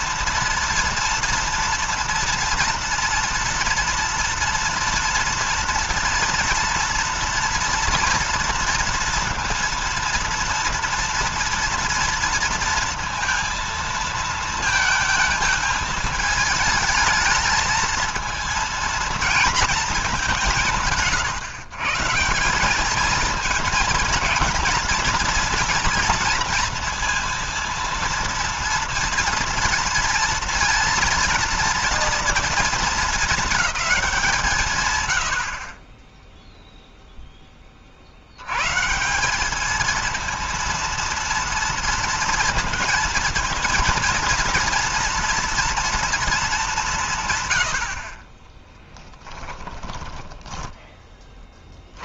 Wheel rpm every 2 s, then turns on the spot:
230, 230, 230, 230, 230, 230, 230, 220, 220, 230, 180, 190, 230, 230, 230, 230, 220, 150, 0, 110, 230, 230, 230, 190, 10, 10.
48-52